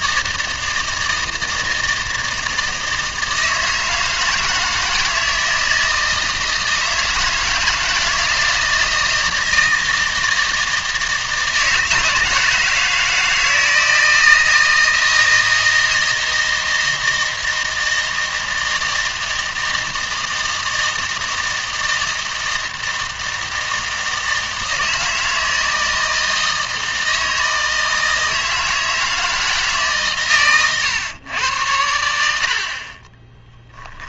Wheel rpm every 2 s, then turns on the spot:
160, 160, 160, 160, 160, 160, 160, 160, 160, 160, 160, 160, 160, 160, 160, 120, 40.
none